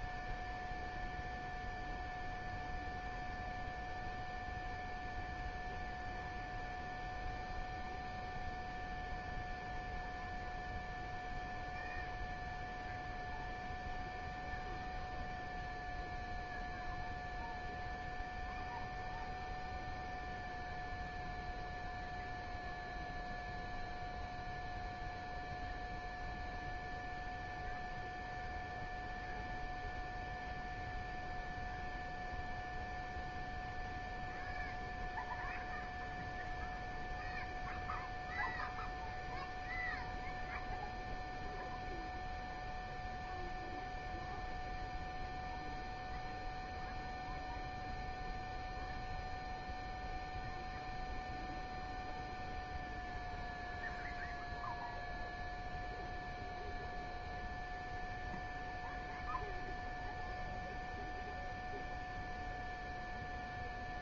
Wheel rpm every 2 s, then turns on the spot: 0, 0, 0, 0, 0, 0, 0, 0, 0, 0, 0, 0, 0, 0, 0, 0, 0, 0, 0, 0, 0, 0, 0, 0, 0, 0, 0, 0, 0, 0, 0, 0.
none